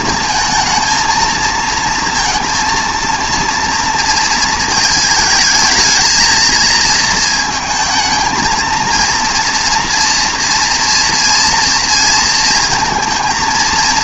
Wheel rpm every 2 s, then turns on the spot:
230, 230, 220, 230, 230, 240, 220.
none